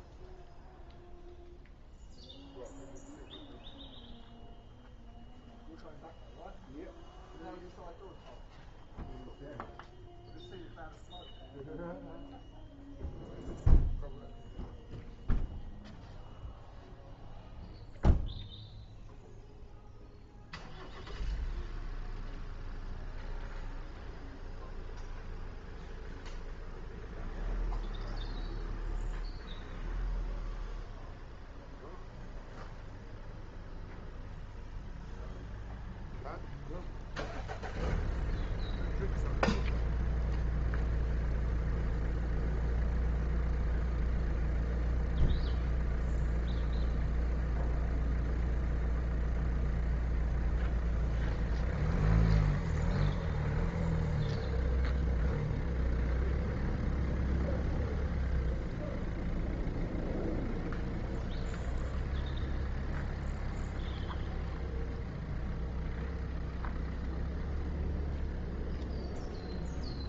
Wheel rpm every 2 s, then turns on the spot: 0, 0, 0, 0, 0, 0, 0, 0, 0, 0, 0, 0, 0, 0, 0, 0, 0, 0, 0, 0, 0, 0, 0, 0, 0, 0, 0, 0, 0, 0, 0, 0, 0, 0, 0.
none